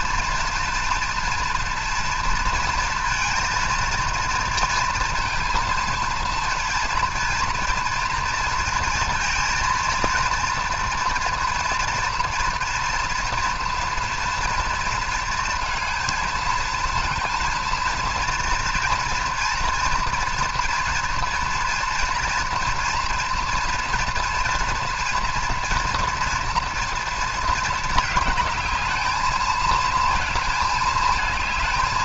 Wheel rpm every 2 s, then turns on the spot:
230, 230, 230, 230, 220, 240, 230, 230, 220, 230, 230, 230, 230, 230, 210, 220.
none